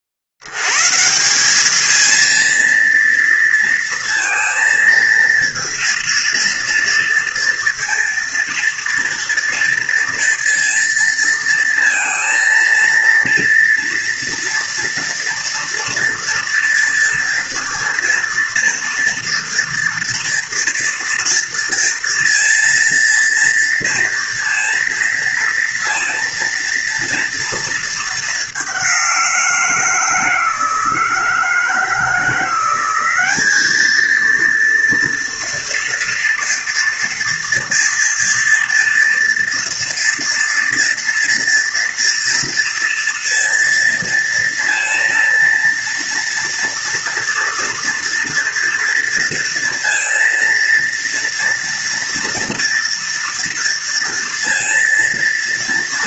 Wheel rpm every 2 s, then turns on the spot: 60, 230, 230, 230, 240, 240, 230, 230, 230, 230, 230, 230, 230, 230, 200, 160, 180, 230, 230, 230, 230, 230, 230, 230, 230, 230, 230, 230.
none